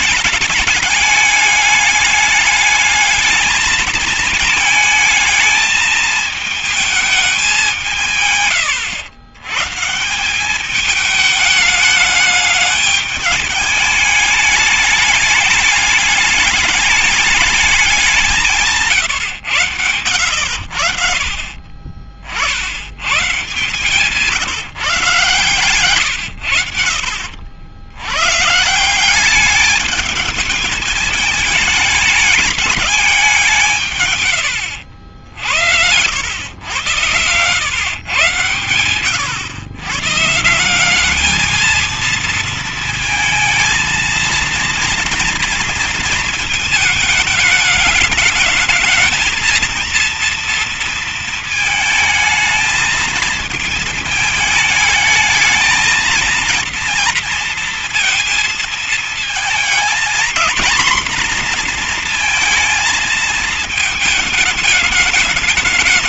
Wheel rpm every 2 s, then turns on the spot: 220, 210, 220, 220, 130, 190, 210, 210, 210, 170, 80, 60, 160, 110, 130, 210, 210, 110, 90, 120, 140, 230, 230, 230, 210, 230, 220, 220, 230, 230, 230, 240, 210.
none